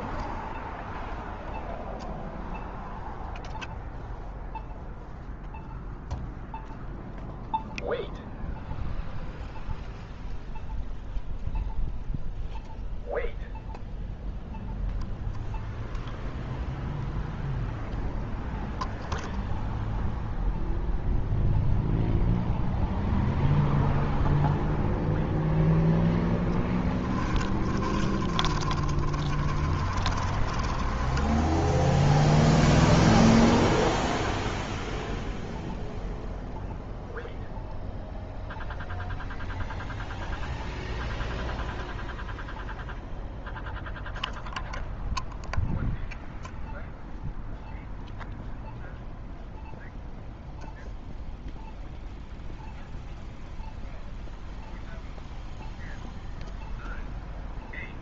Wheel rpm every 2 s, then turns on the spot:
0, 0, 0, 0, 0, 0, 0, 0, 0, 0, 0, 0, 0, 10, 30, 20, 0, 0, 0, 0, 0, 0, 0, 0, 0, 0, 0, 0, 0.
26-32